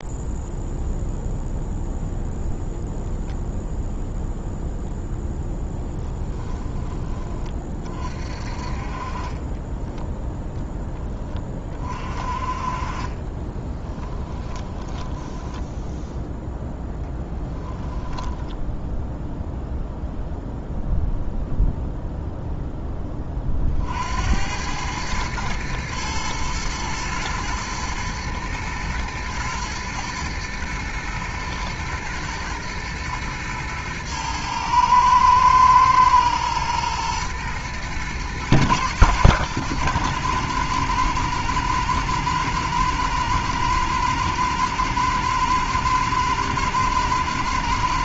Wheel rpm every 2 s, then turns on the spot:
0, 0, 0, 20, 40, 10, 30, 10, 10, 0, 0, 10, 100, 110, 110, 110, 110, 110, 110, 120, 110, 120, 120, 120.
12-16